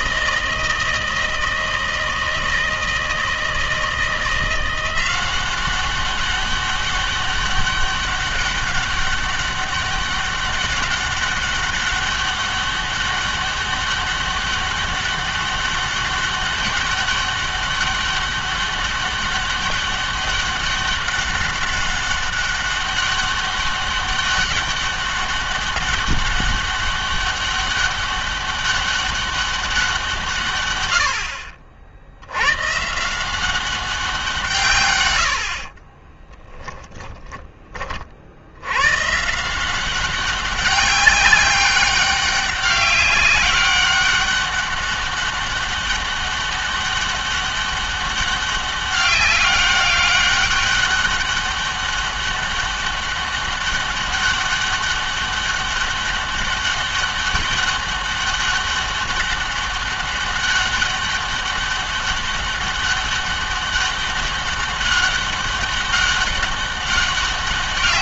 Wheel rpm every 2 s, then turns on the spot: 160, 160, 170, 200, 200, 200, 200, 200, 200, 200, 200, 200, 200, 200, 200, 110, 130, 120, 10, 100, 200, 200, 200, 200, 200, 200, 200, 200, 200, 200, 200, 200, 200, 200.
36-38